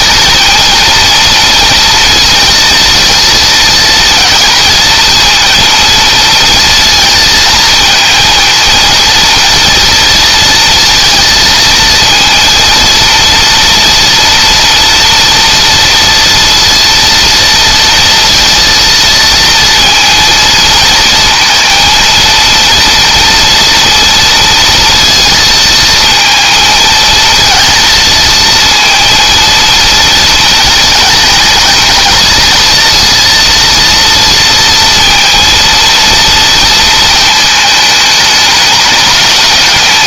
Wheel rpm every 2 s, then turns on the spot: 230, 230, 230, 230, 230, 230, 230, 230, 230, 230, 230, 230, 230, 230, 230, 230, 230, 230, 220, 210.
none